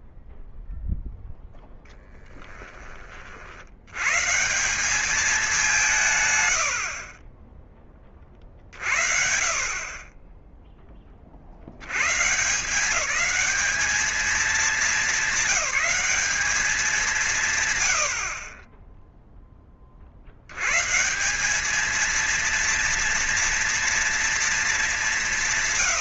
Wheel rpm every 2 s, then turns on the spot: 0, 20, 160, 110, 40, 20, 160, 220, 200, 40, 90, 230, 210.
none